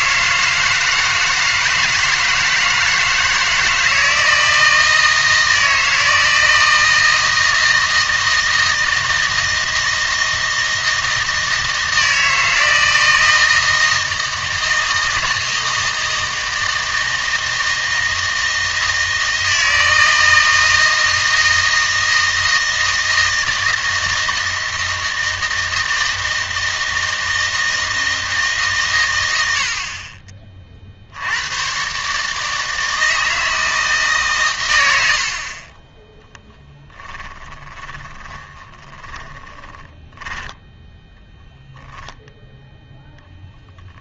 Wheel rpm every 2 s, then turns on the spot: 160, 160, 160, 160, 160, 160, 160, 160, 160, 160, 160, 160, 160, 160, 140, 40, 160, 120, 10, 10, 10, 0.
36-40